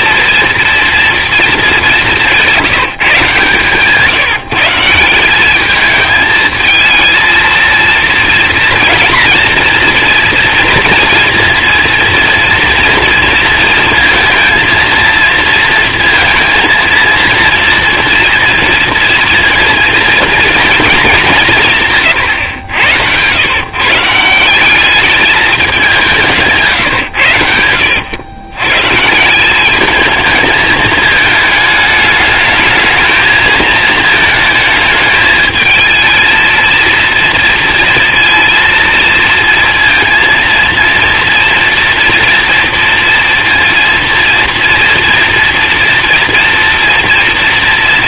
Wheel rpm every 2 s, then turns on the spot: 230, 150, 180, 230, 230, 230, 230, 230, 230, 230, 200, 100, 210, 110, 170, 220, 220, 220, 230, 230, 230, 230, 230, 230.
none